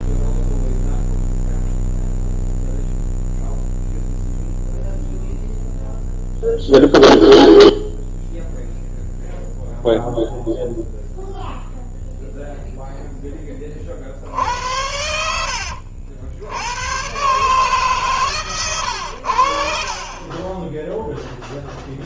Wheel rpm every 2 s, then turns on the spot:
0, 0, 0, 0, 0, 0, 0, 70, 80, 120, 20.
14-16 18-22